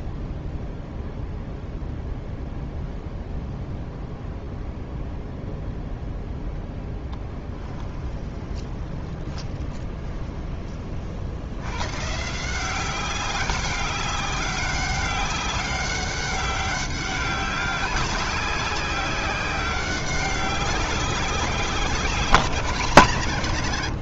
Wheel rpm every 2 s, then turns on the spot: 0, 0, 0, 10, 20, 40, 180, 200, 200, 190, 190, 170.
8-10